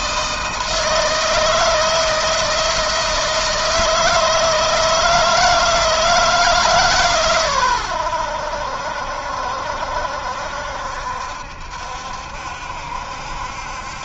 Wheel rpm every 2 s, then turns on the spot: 160, 160, 160, 150, 80, 70, 70.
none